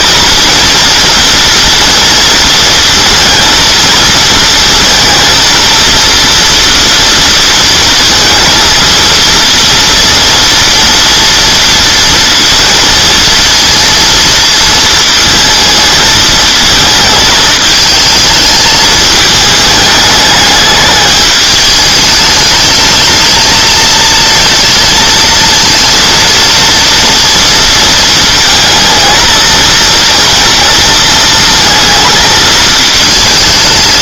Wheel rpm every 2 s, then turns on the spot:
230, 230, 230, 230, 230, 230, 230, 230, 220, 220, 210, 220, 230, 230, 220, 230, 220.
none